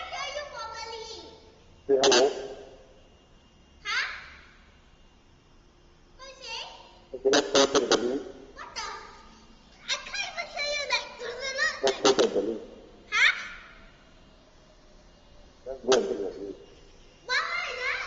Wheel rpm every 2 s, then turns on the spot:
0, 0, 0, 0, 0, 0, 0, 0, 0.
none